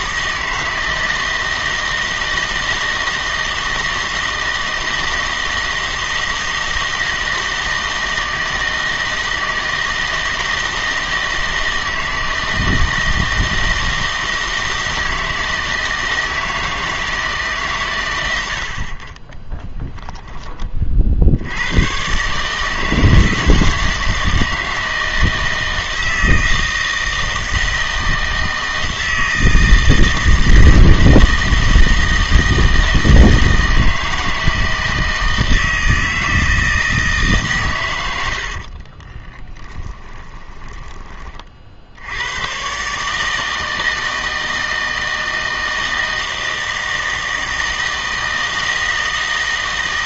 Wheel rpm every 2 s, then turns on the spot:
160, 160, 160, 160, 160, 160, 160, 160, 160, 70, 30, 150, 160, 160, 160, 160, 160, 160, 160, 50, 20, 120, 160, 160, 160.
38-42